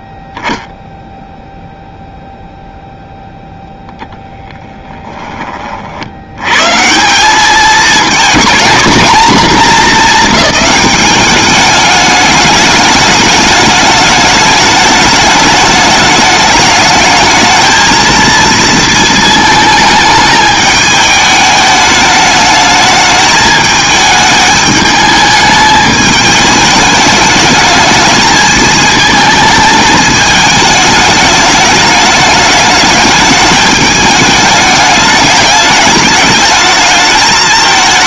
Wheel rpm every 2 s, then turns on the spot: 0, 0, 10, 120, 230, 200, 210, 210, 210, 230, 210, 210, 210, 210, 220, 220, 210, 210, 220.
4-6